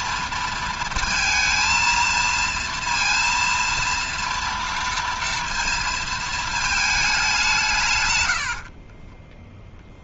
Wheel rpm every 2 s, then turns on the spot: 220, 230, 230, 180, 10.
none